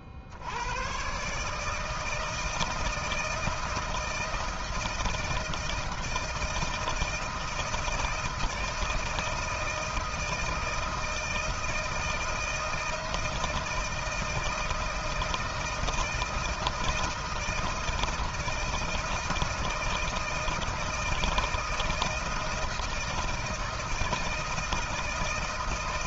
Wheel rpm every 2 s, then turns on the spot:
40, 160, 160, 160, 160, 160, 160, 160, 160, 160, 160, 160, 160.
none